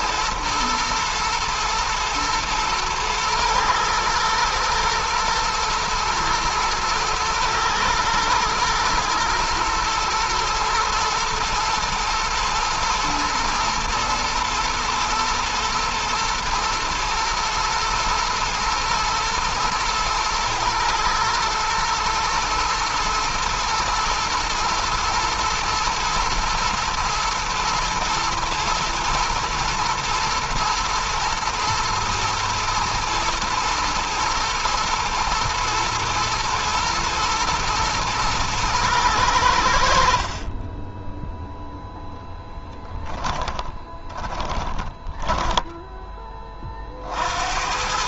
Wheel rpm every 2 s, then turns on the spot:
110, 110, 110, 120, 120, 110, 110, 120, 120, 110, 110, 110, 110, 120, 120, 110, 120, 120, 120, 110, 10, 10, 10, 40.
42-46